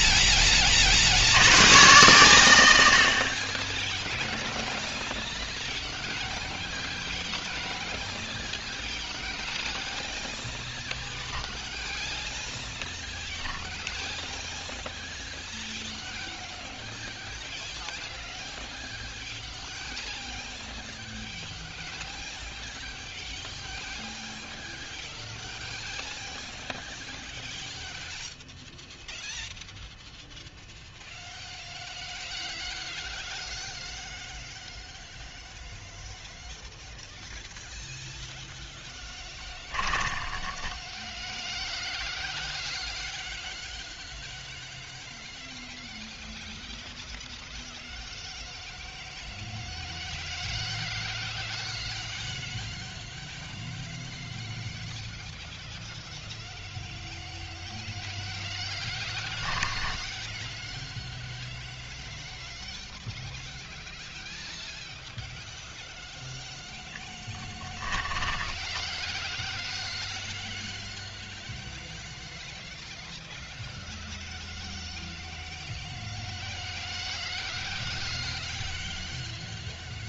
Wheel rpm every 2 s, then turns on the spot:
40, 80, 0, 0, 0, 0, 0, 0, 0, 0, 0, 0, 0, 0, 0, 0, 0, 0, 0, 0, 10, 0, 0, 0, 0, 0, 0, 0, 0, 0, 0, 0, 0, 10, 10, 0, 0, 0, 0, 0.
68-70